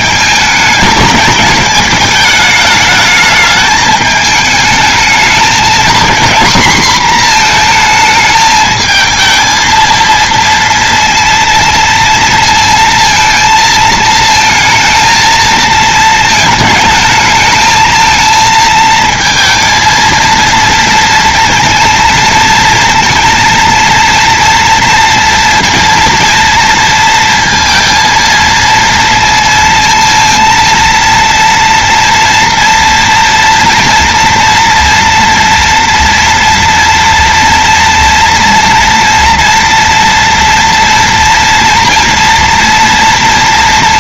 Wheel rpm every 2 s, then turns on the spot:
210, 210, 220, 240, 220, 230, 230, 230, 220, 220, 230, 230, 230, 230, 230, 230, 230, 230, 230, 230, 240, 230.
none